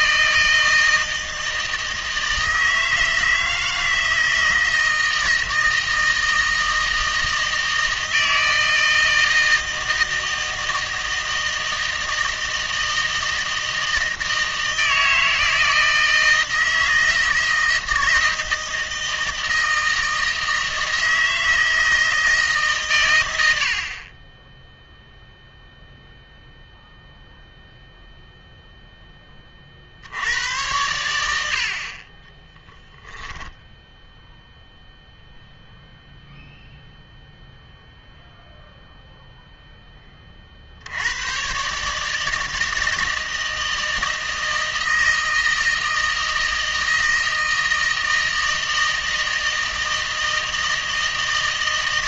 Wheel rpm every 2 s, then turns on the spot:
160, 160, 160, 160, 160, 160, 160, 160, 160, 160, 160, 140, 0, 0, 0, 90, 0, 0, 0, 0, 60, 160, 160, 160, 160, 160.
none